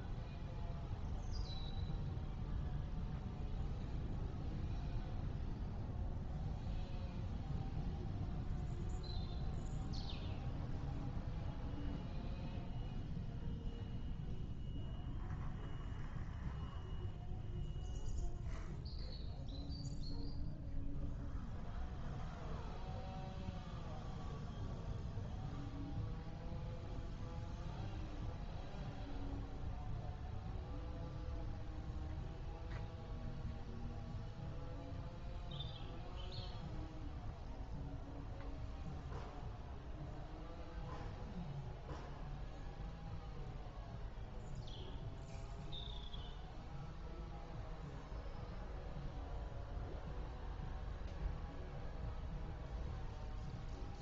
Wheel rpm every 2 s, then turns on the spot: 0, 0, 0, 0, 0, 0, 0, 0, 0, 0, 0, 0, 0, 0, 0, 0, 0, 0, 0, 0, 0, 0, 0, 0, 0, 0, 0.
none